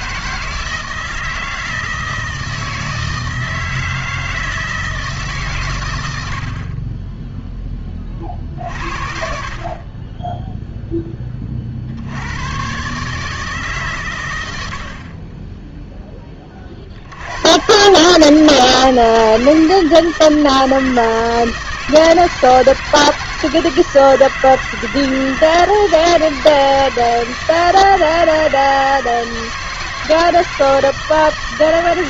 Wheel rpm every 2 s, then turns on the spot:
160, 160, 160, 40, 50, 0, 130, 80, 50, 160, 160, 160, 160, 160, 160, 160.
none